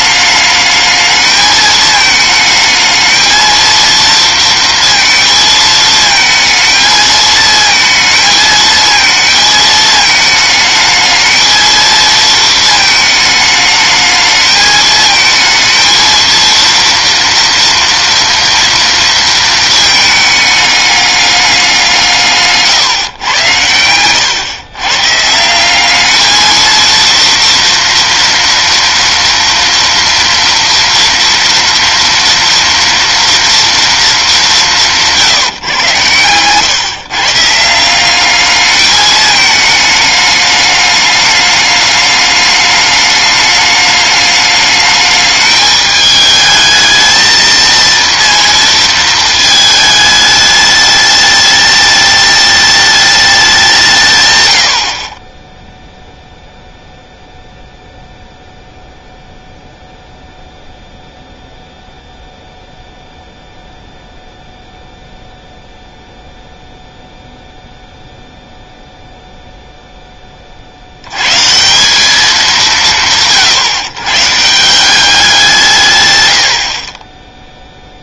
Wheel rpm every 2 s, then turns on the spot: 210, 220, 230, 220, 220, 220, 220, 220, 230, 230, 210, 150, 110, 220, 230, 230, 230, 190, 120, 210, 210, 210, 210, 220, 230, 210, 210, 90, 0, 0, 0, 0, 0, 0, 0, 40, 190, 150, 80.
none